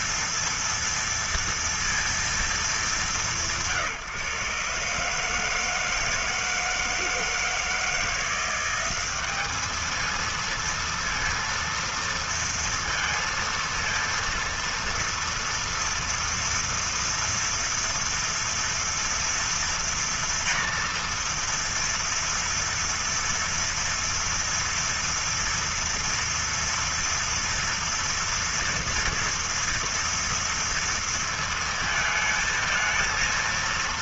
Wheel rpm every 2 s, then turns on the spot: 230, 190, 140, 160, 190, 230, 230, 230, 230, 230, 230, 230, 230, 230, 230, 230, 220.
none